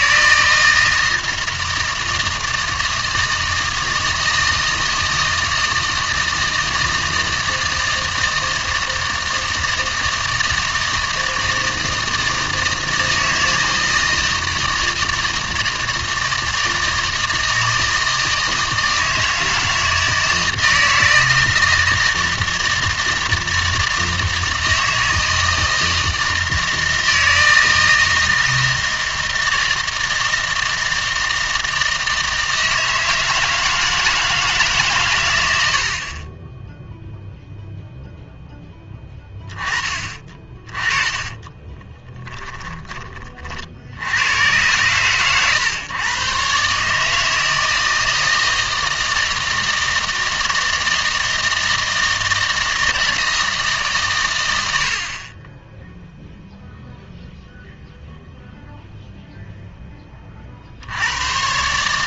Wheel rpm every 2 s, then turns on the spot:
160, 160, 160, 160, 160, 160, 160, 160, 160, 160, 160, 160, 160, 160, 160, 160, 160, 140, 0, 10, 30, 20, 110, 140, 160, 160, 160, 80, 0, 0, 60.
40-44